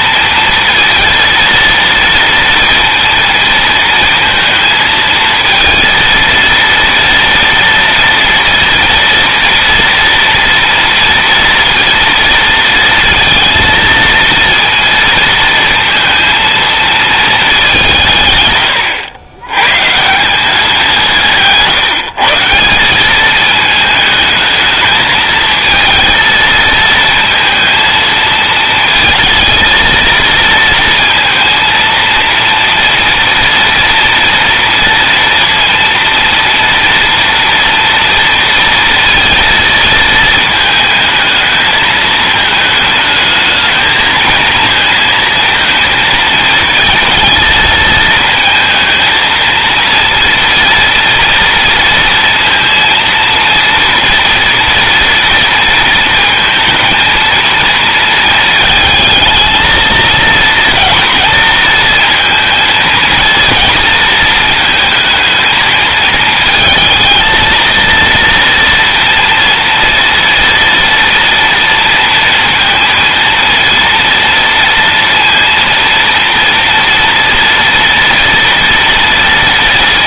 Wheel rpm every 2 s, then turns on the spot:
230, 230, 220, 230, 230, 230, 230, 230, 220, 100, 180, 190, 220, 230, 220, 220, 230, 230, 230, 230, 220, 220, 230, 230, 220, 230, 230, 240, 230, 220, 230, 220, 220, 230, 230, 240, 230, 230, 230, 230.
none